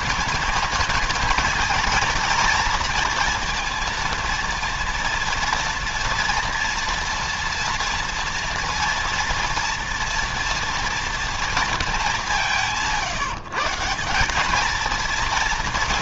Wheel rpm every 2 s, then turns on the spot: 220, 230, 230, 230, 230, 230, 150, 220.
none